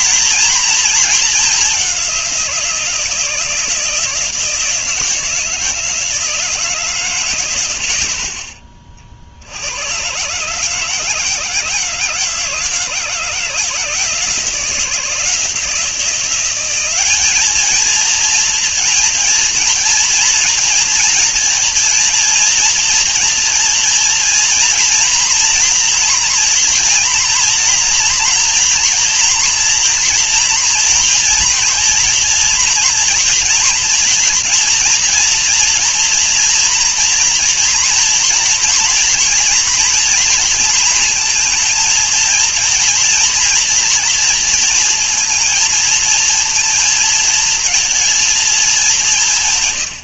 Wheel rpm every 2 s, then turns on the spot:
230, 170, 170, 150, 30, 150, 160, 160, 190, 230, 230, 230, 230, 230, 230, 230, 230, 240, 230, 230, 230, 230, 230, 230, 210.
none